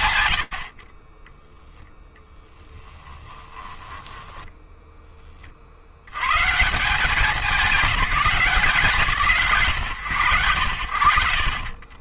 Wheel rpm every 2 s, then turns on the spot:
60, 10, 10, 180, 180, 80.
2-4